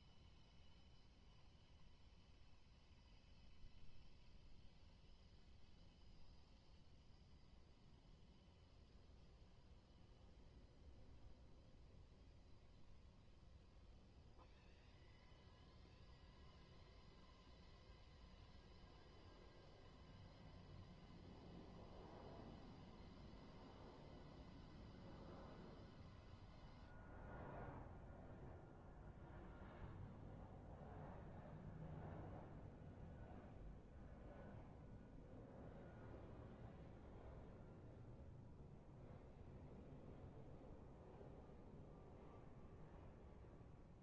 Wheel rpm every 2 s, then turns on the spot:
0, 0, 0, 0, 0, 0, 0, 0, 0, 0, 0, 0, 0, 0, 0, 0, 0, 0, 0, 0, 0, 0.
none